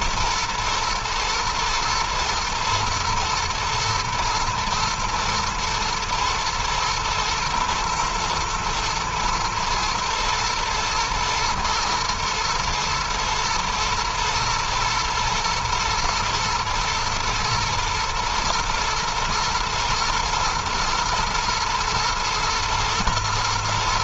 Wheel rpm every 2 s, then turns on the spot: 120, 110, 110, 120, 110, 110, 120, 110, 120, 120, 120, 120.
none